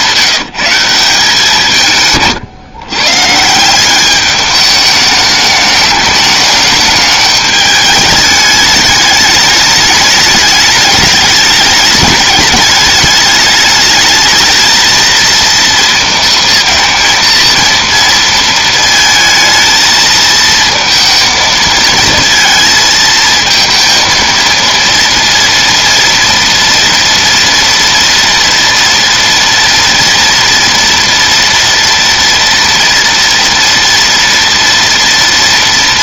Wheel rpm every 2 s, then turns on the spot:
170, 140, 210, 210, 210, 210, 210, 230, 230, 220, 220, 220, 230, 230, 230, 230, 230, 230.
none